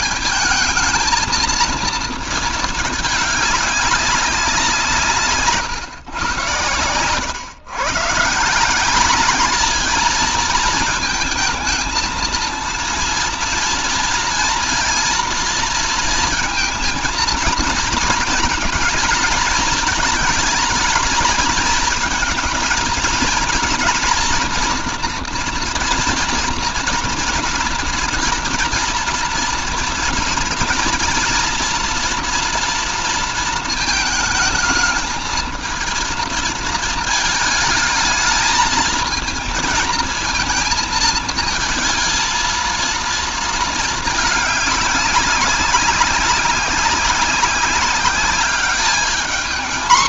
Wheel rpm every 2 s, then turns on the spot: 220, 220, 170, 110, 180, 220, 230, 230, 230, 220, 220, 230, 240, 230, 240, 230, 240, 220, 230, 220, 220, 220, 200, 190, 210.
none